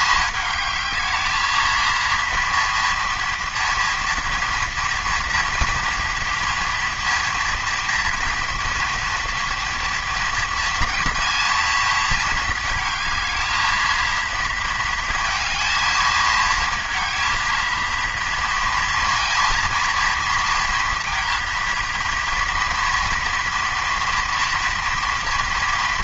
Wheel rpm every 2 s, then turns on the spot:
220, 230, 230, 230, 240, 240, 220, 220, 230, 230, 230, 230, 230.
none